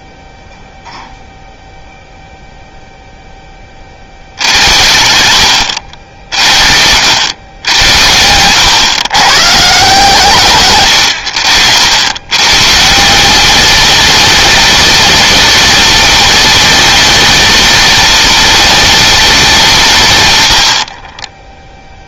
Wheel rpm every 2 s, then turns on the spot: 0, 0, 80, 80, 120, 100, 160, 210, 210, 210, 60.
none